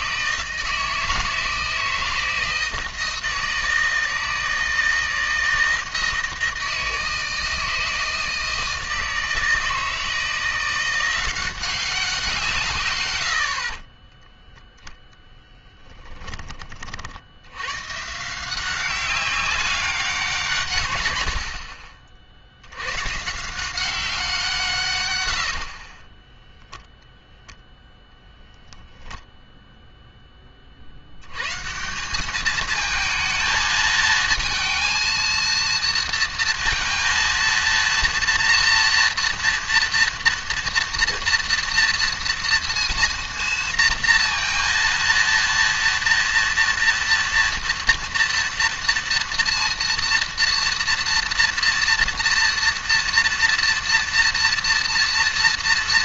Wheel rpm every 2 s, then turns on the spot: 160, 160, 160, 160, 160, 170, 150, 0, 30, 180, 150, 70, 160, 10, 0, 40, 220, 230, 230, 230, 230, 230, 230, 230, 230, 230, 230, 230.
none